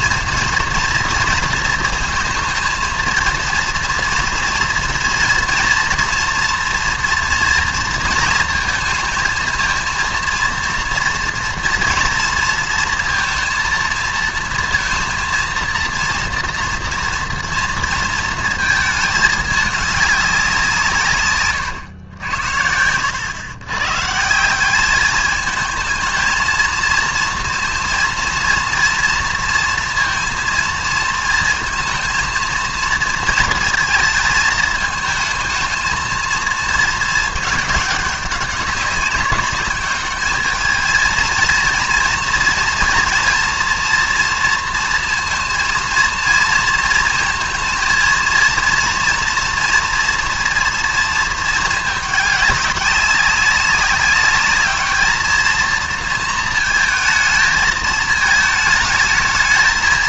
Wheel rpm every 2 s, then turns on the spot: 230, 230, 230, 230, 220, 230, 230, 230, 230, 220, 180, 70, 170, 230, 230, 230, 230, 220, 230, 200, 220, 230, 230, 230, 230, 230, 200, 210, 230, 220.
none